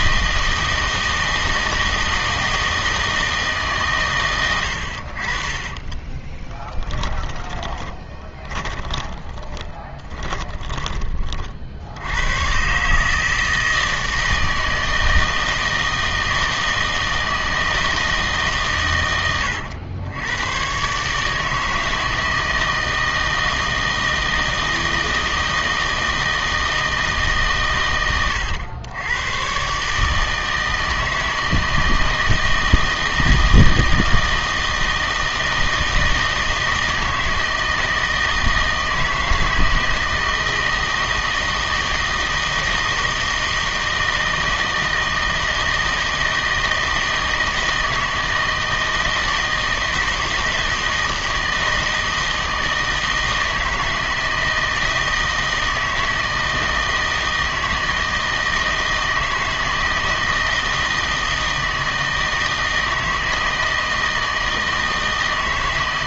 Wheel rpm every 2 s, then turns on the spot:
160, 160, 90, 10, 20, 20, 120, 160, 160, 140, 120, 160, 160, 160, 100, 160, 160, 160, 160, 160, 160, 160, 160, 160, 160, 160, 160, 160, 160, 160, 160, 160, 160.
6-12